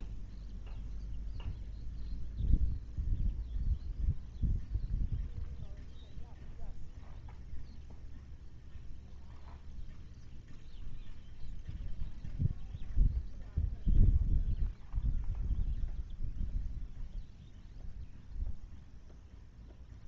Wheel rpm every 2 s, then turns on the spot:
0, 0, 0, 0, 0, 0, 0, 0, 0, 0.
none